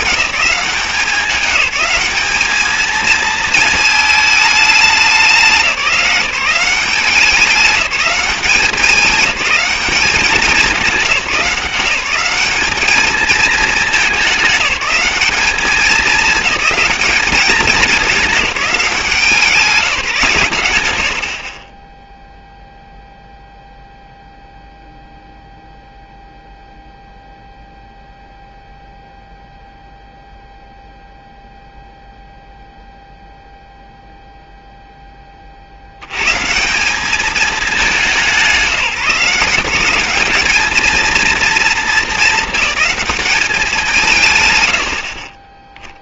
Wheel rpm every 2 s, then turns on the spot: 190, 220, 210, 190, 200, 200, 200, 200, 210, 200, 150, 0, 0, 0, 0, 0, 0, 0, 150, 180, 210, 220, 110.
none